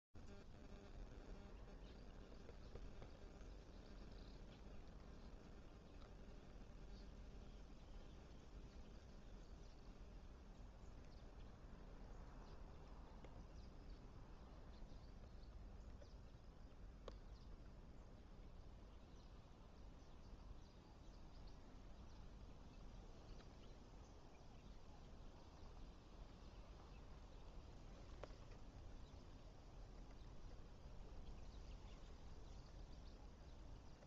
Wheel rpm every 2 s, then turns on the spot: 0, 0, 0, 0, 0, 0, 0, 0, 0, 0, 0, 0, 0, 0, 0, 0, 0.
none